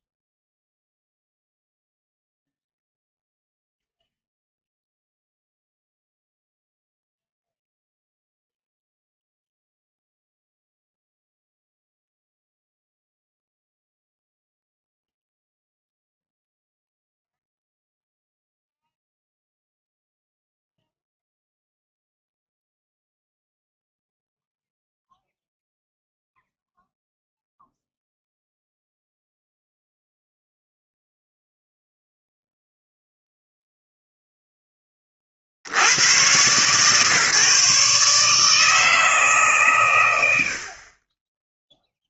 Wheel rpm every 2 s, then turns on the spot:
0, 0, 0, 0, 0, 0, 0, 0, 0, 0, 0, 0, 0, 0, 0, 0, 0, 10, 130, 150, 50.
none